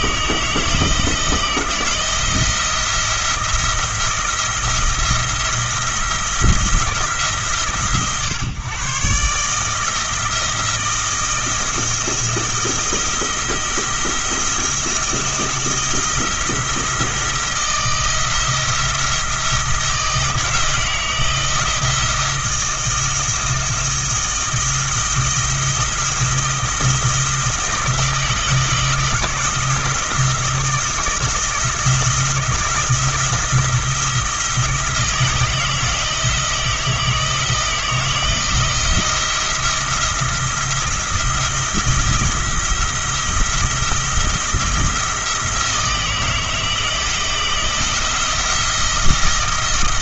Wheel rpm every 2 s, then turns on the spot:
160, 170, 170, 170, 130, 170, 170, 170, 170, 170, 170, 170, 170, 160, 160, 160, 160, 160, 160, 170, 170, 170, 170, 160, 170.
none